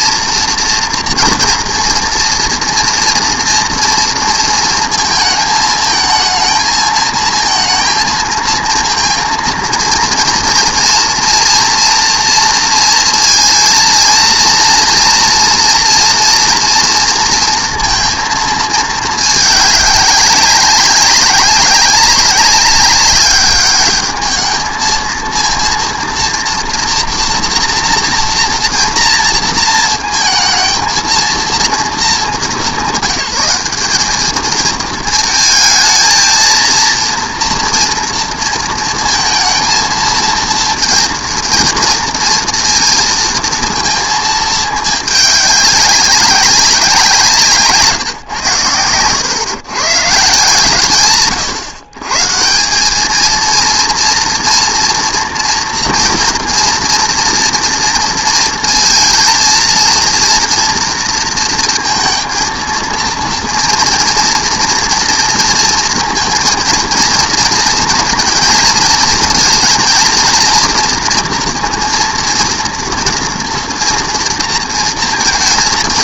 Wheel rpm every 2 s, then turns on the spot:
230, 230, 230, 220, 230, 230, 230, 230, 230, 220, 200, 200, 220, 230, 230, 220, 170, 230, 230, 230, 230, 230, 210, 190, 110, 150, 180, 230, 230, 230, 230, 230, 230, 230, 230, 230, 230, 230.
none